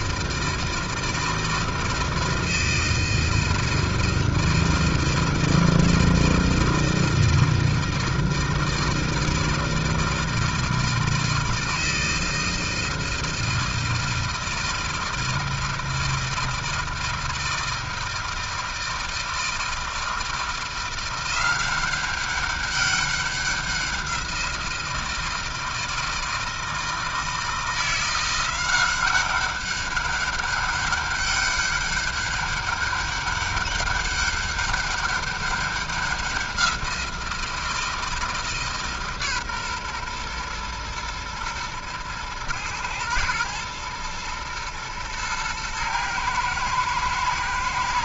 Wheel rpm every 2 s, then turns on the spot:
160, 160, 160, 160, 160, 160, 160, 160, 160, 160, 170, 200, 170, 160, 180, 200, 200, 200, 180, 160, 120, 110, 120, 110.
none